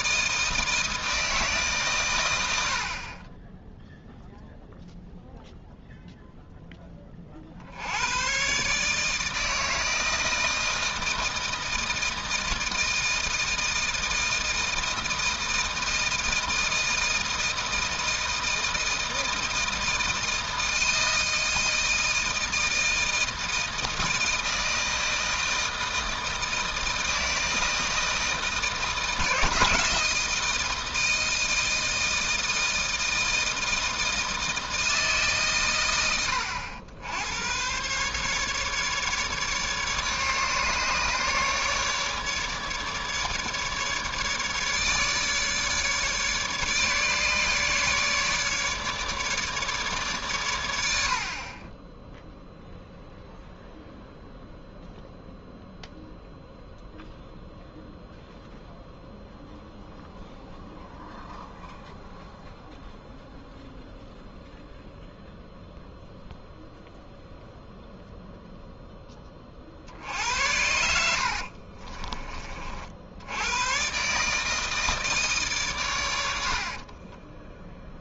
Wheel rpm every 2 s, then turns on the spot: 160, 70, 0, 10, 140, 160, 160, 160, 160, 160, 170, 160, 160, 160, 160, 160, 160, 160, 90, 150, 150, 150, 150, 150, 150, 90, 0, 0, 0, 0, 0, 0, 0, 0, 10, 80, 50, 160, 60.
none